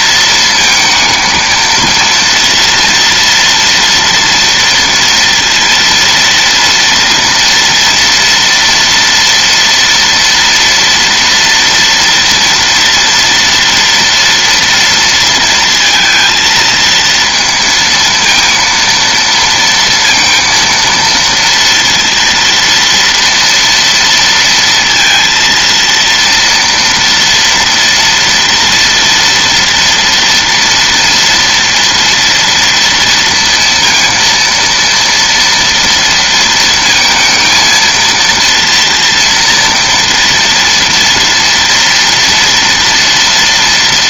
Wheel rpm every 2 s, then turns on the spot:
220, 230, 230, 230, 230, 230, 230, 230, 230, 230, 230, 230, 230, 230, 240, 230, 230, 230, 220, 230, 230, 230.
none